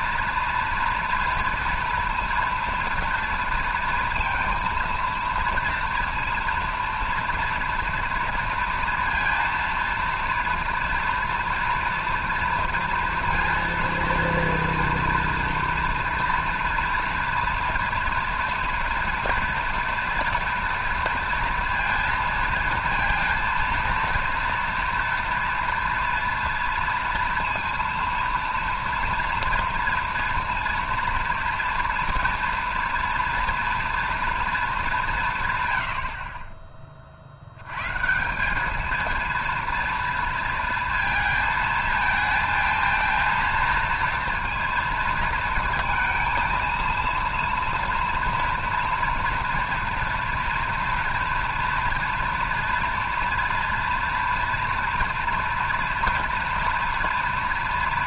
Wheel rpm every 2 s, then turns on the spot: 230, 230, 230, 230, 230, 230, 230, 230, 230, 230, 230, 230, 230, 230, 230, 230, 230, 190, 40, 230, 230, 230, 230, 230, 230, 230, 230, 230, 230.
none